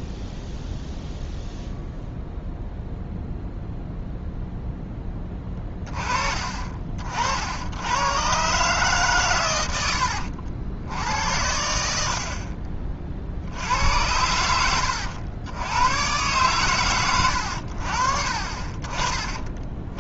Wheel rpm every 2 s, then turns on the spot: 0, 0, 0, 30, 140, 70, 50, 90, 120, 50.
none